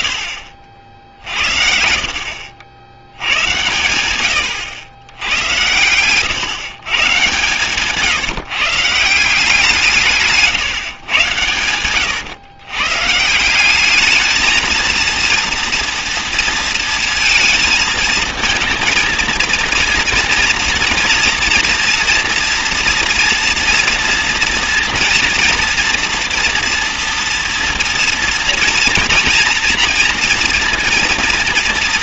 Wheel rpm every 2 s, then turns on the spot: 50, 80, 90, 130, 150, 140, 120, 220, 220, 220, 230, 240, 230, 240, 230, 230.
none